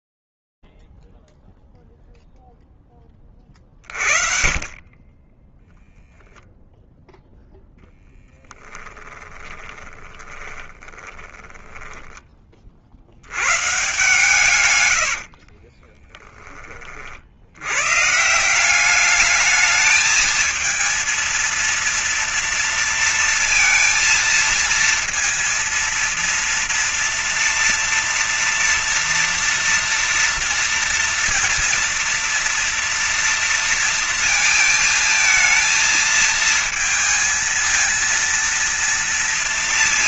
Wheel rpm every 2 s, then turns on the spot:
0, 0, 40, 0, 10, 20, 70, 90, 50, 200, 230, 230, 230, 230, 230, 230, 230, 220, 230, 230.
8-12 14-16